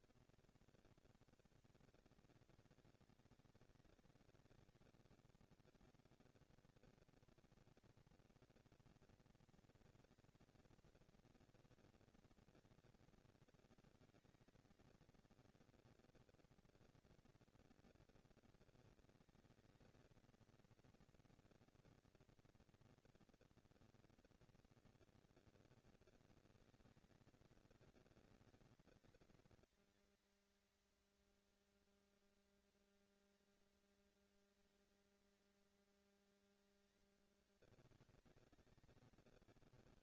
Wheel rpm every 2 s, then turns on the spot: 210, 200, 200, 230, 240, 230, 230, 230, 230, 220, 230, 230, 230, 230, 230, 230, 230, 230, 220, 190.
none